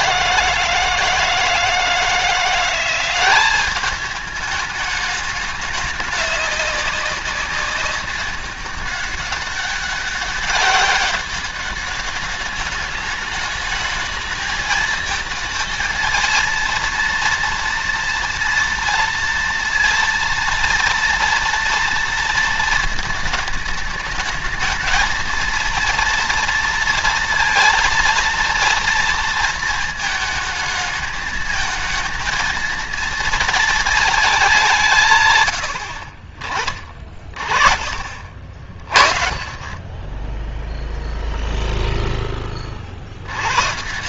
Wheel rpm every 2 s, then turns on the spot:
160, 180, 210, 200, 200, 190, 210, 220, 230, 240, 230, 220, 220, 230, 230, 220, 230, 150, 30, 60, 0, 60.
none